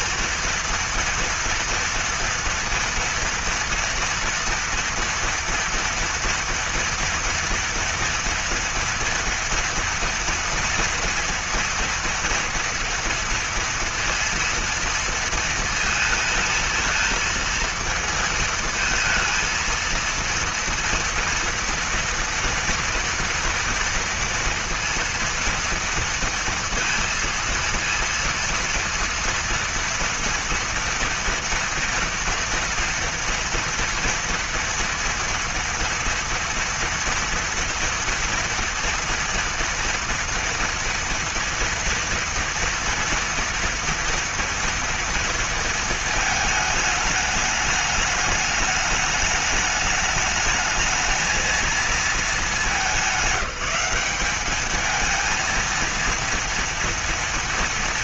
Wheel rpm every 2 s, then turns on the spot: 240, 230, 240, 230, 230, 230, 230, 230, 220, 220, 230, 230, 230, 230, 230, 230, 230, 230, 230, 230, 230, 230, 230, 220, 210, 220, 220, 210, 230.
none